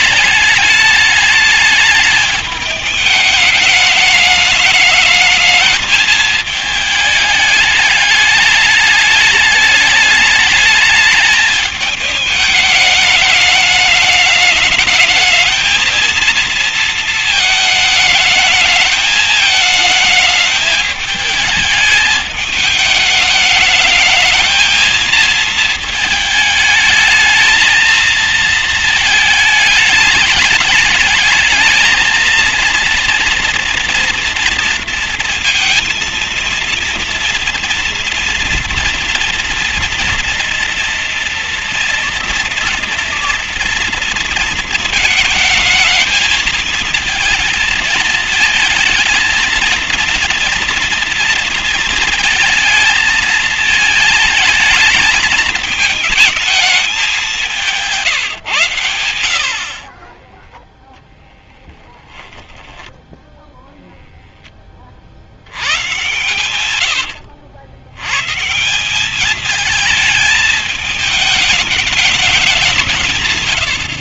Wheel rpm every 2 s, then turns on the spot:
210, 210, 220, 210, 210, 210, 210, 220, 220, 220, 210, 210, 220, 220, 220, 210, 230, 230, 230, 240, 230, 230, 220, 220, 230, 230, 220, 220, 190, 70, 0, 0, 30, 100, 170, 210, 180.
66-68